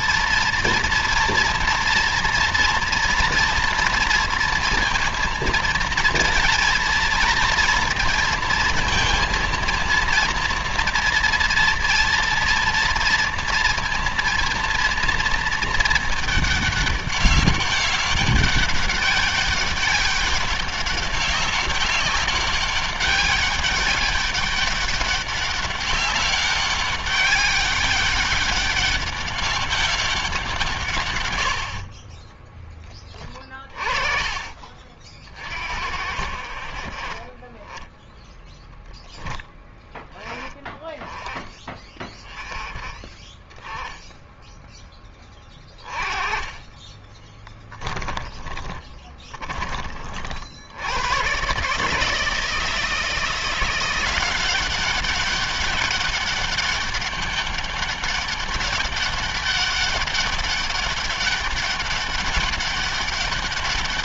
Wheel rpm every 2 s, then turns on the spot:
230, 230, 230, 230, 230, 230, 230, 230, 210, 200, 200, 190, 200, 200, 200, 150, 10, 40, 40, 0, 10, 20, 10, 20, 30, 100, 170, 190, 200, 200, 200, 200.
46-50